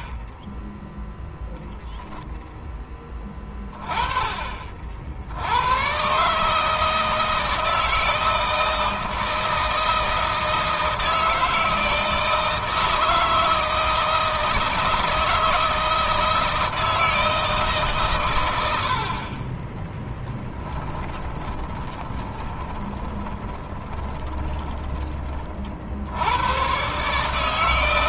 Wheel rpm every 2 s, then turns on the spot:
0, 10, 40, 150, 160, 160, 160, 170, 160, 90, 10, 20, 30, 120.
20-26